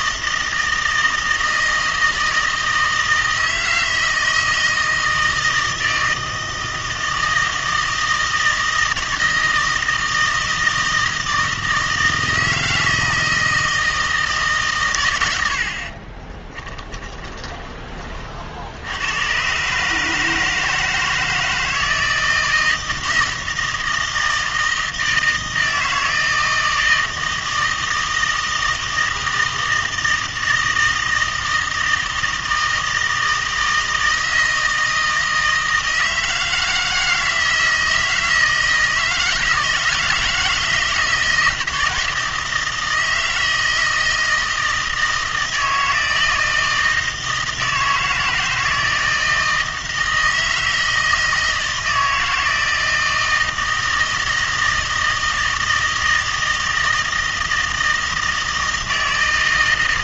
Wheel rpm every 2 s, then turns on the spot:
160, 160, 160, 160, 160, 160, 160, 130, 20, 80, 160, 160, 160, 160, 160, 160, 160, 160, 160, 160, 160, 160, 160, 160, 160, 160, 160, 160, 160, 160.
16-18